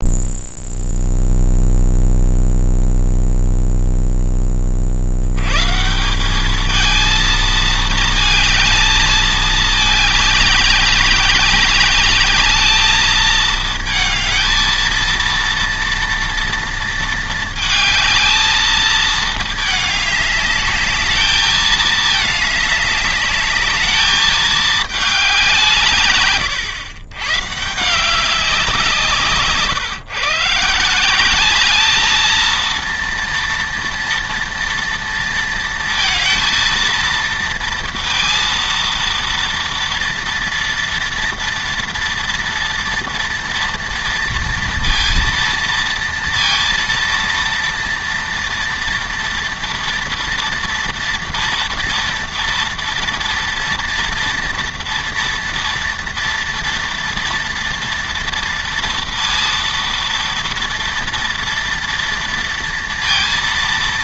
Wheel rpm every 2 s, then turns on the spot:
0, 0, 30, 220, 220, 200, 210, 220, 230, 220, 210, 210, 210, 130, 180, 150, 230, 230, 230, 230, 230, 230, 230, 230, 230, 230, 230, 230, 230, 230, 230, 230.
none